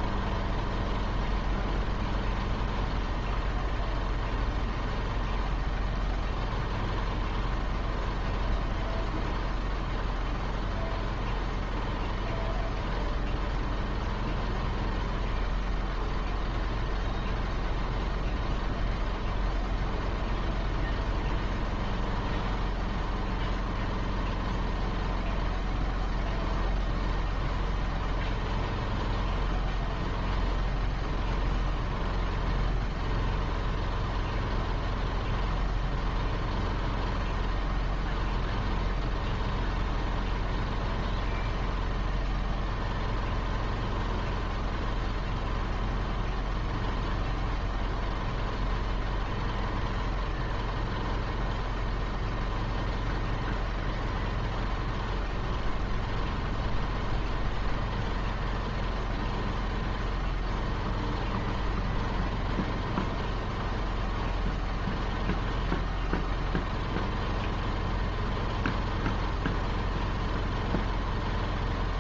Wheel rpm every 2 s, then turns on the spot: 0, 0, 0, 0, 0, 0, 0, 0, 0, 0, 0, 0, 0, 0, 0, 0, 0, 0, 0, 0, 0, 0, 0, 0, 0, 0, 0, 0, 0, 0, 0, 0, 0, 0, 0, 0.
none